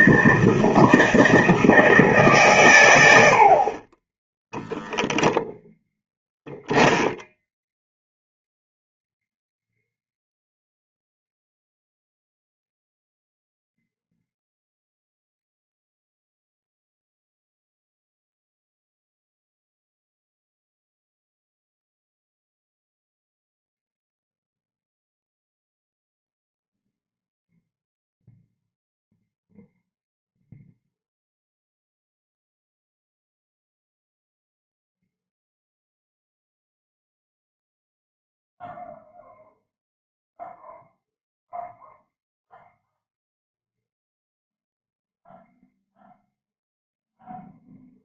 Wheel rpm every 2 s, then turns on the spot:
160, 130, 0, 0, 0, 0, 0, 0, 0, 0, 0, 0, 0, 0, 0, 0, 0, 0, 0, 0, 0, 0, 0, 0.
none